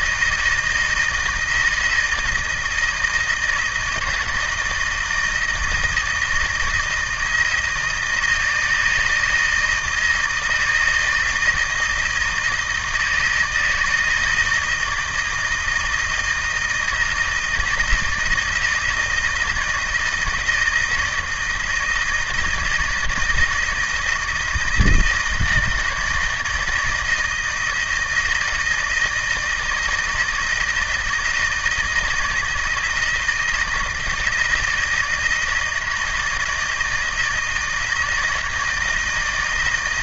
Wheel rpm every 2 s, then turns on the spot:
160, 160, 170, 160, 160, 160, 160, 160, 160, 160, 160, 160, 160, 160, 160, 160, 160, 170, 160, 160.
none